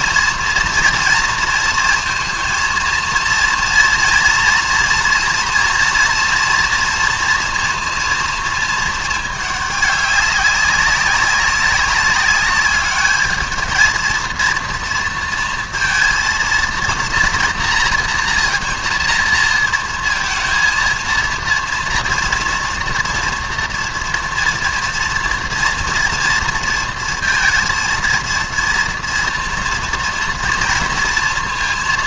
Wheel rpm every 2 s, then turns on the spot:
230, 230, 230, 230, 230, 200, 200, 220, 230, 230, 230, 230, 230, 230, 230, 240.
none